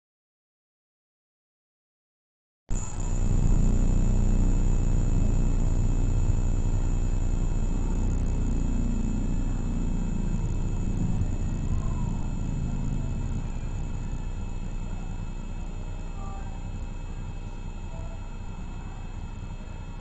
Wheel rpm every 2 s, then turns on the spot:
0, 0, 0, 0, 0, 0, 0, 0, 0, 0.
none